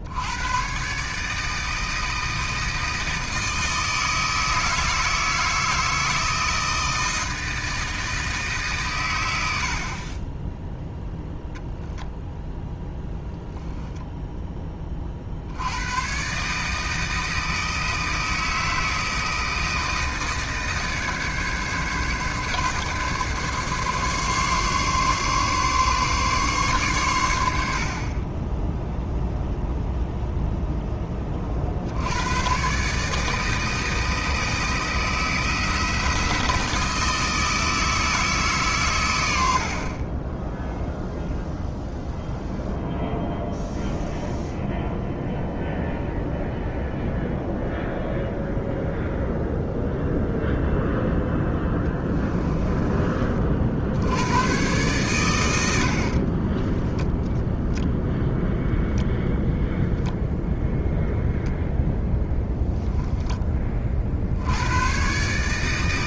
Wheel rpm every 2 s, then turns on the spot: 120, 160, 160, 160, 140, 10, 0, 10, 150, 160, 150, 140, 140, 140, 10, 0, 130, 160, 160, 140, 10, 0, 0, 0, 0, 0, 20, 120, 20, 0, 0, 0, 90.
52-54 56-58